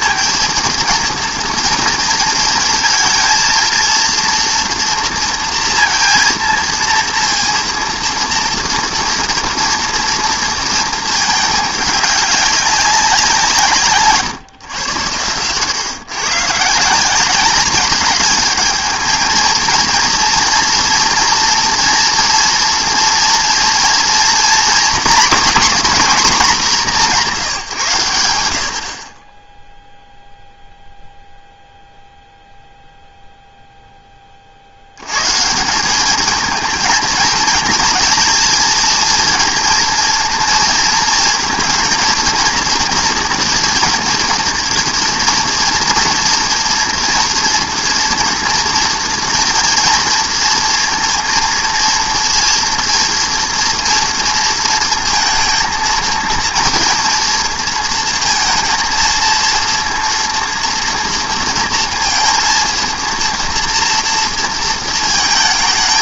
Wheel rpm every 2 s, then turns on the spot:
230, 230, 230, 230, 240, 230, 200, 120, 140, 210, 230, 230, 240, 210, 60, 0, 0, 70, 230, 230, 220, 230, 230, 230, 240, 230, 230, 230, 230, 230, 230, 230, 230.
none